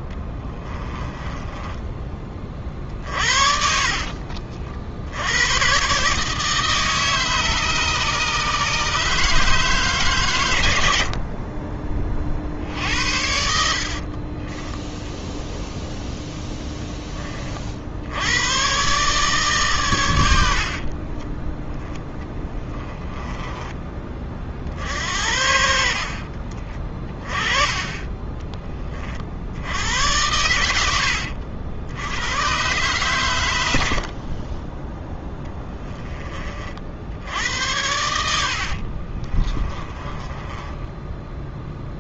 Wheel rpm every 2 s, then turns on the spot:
20, 40, 70, 150, 150, 70, 80, 10, 10, 130, 50, 10, 60, 30, 30, 80, 130, 10, 60, 50, 10.
0-4 12-14 20-24 26-28 38-42